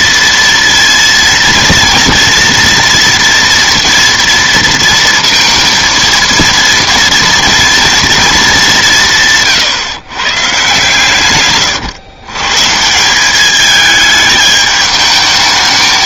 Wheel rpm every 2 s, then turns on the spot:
230, 230, 230, 230, 190, 140, 170, 210.
none